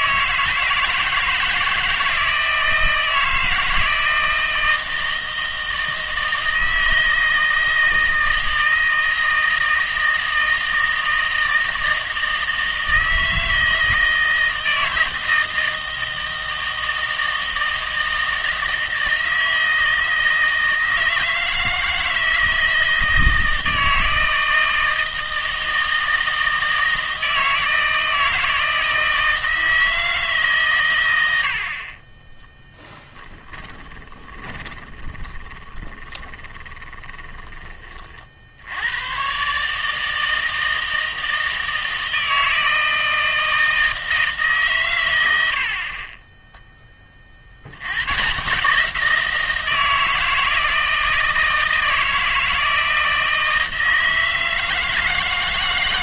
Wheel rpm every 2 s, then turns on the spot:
160, 160, 160, 160, 160, 160, 160, 160, 160, 160, 160, 160, 160, 160, 160, 130, 10, 20, 20, 70, 160, 160, 130, 10, 160, 160, 160, 160.
32-38